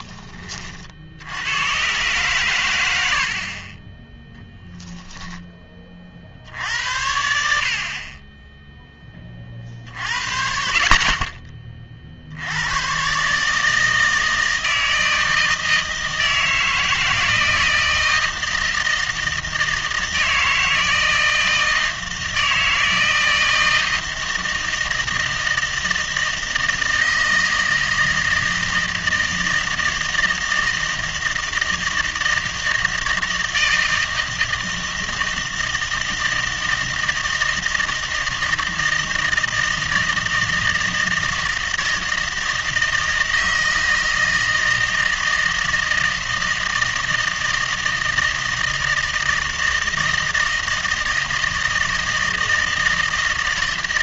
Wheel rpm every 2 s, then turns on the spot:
30, 110, 0, 80, 10, 50, 100, 160, 160, 160, 160, 160, 160, 160, 160, 160, 160, 160, 160, 170, 160, 160, 160, 160, 160, 160, 160.
none